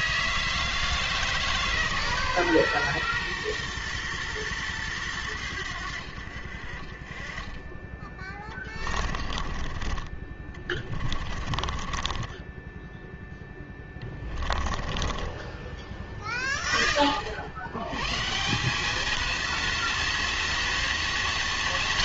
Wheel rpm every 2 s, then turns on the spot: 160, 120, 110, 50, 20, 30, 10, 30, 20, 190, 230.
8-16